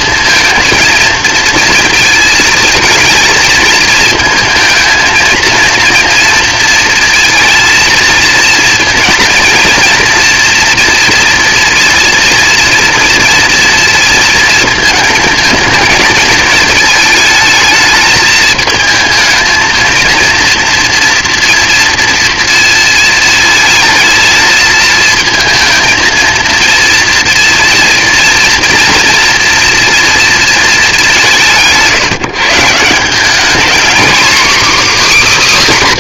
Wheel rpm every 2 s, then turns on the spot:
230, 220, 230, 230, 230, 240, 230, 220, 220, 220, 230, 230, 220, 230, 230, 220, 160, 280.
none